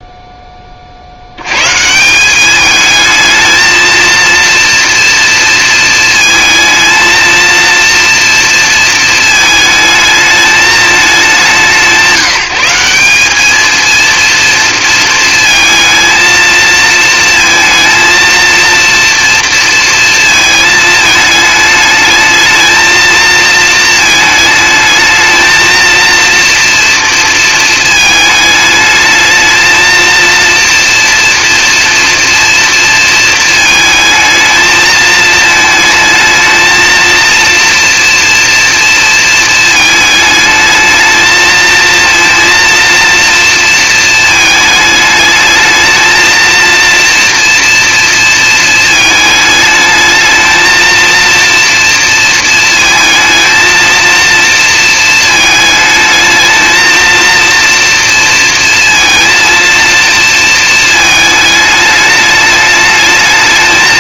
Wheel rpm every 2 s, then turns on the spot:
20, 200, 230, 220, 230, 220, 170, 230, 230, 230, 220, 220, 220, 230, 220, 230, 230, 220, 220, 230, 210, 230, 220, 230, 220, 220, 230, 230, 220, 230, 230, 210.
none